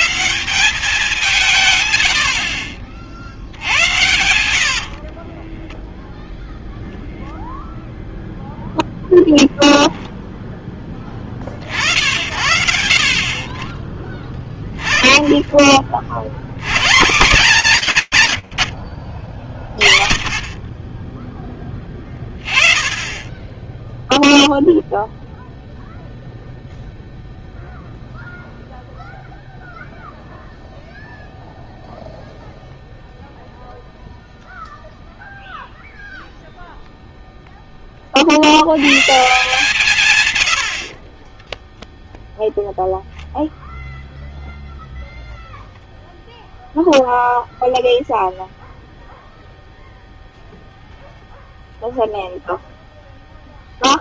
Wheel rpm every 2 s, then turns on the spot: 150, 70, 80, 0, 0, 0, 80, 10, 80, 80, 20, 20, 0, 0, 0, 0, 0, 0, 0, 130, 70, 0, 0, 0, 0, 0, 0.
4-6